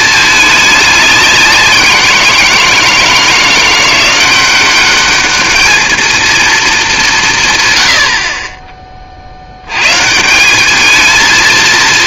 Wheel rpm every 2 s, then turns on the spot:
210, 170, 190, 220, 30, 190.
none